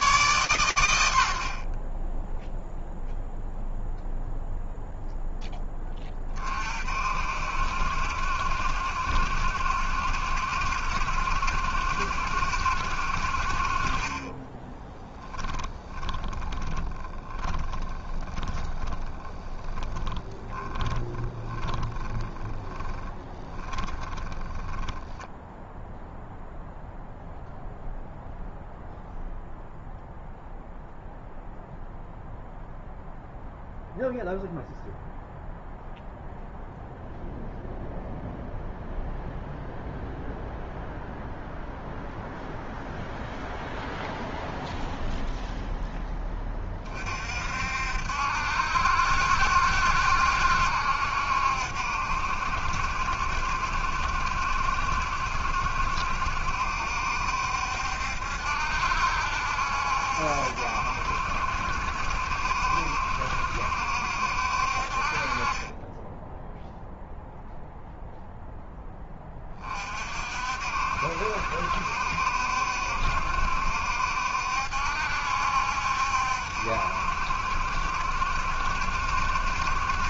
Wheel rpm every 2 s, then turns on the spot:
90, 0, 0, 60, 70, 70, 40, 10, 20, 10, 10, 10, 0, 0, 0, 0, 0, 0, 0, 0, 0, 0, 0, 50, 70, 70, 70, 70, 70, 70, 70, 70, 50, 0, 20, 70, 70, 70, 70, 70.
14-24